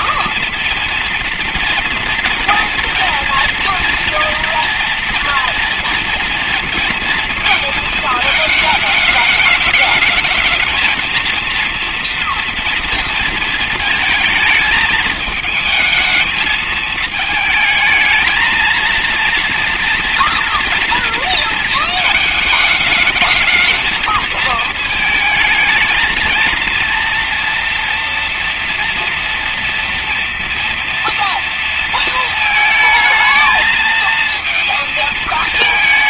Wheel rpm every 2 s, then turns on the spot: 230, 230, 240, 230, 220, 220, 230, 220, 220, 220, 230, 220, 220, 230, 230, 230, 220, 220.
none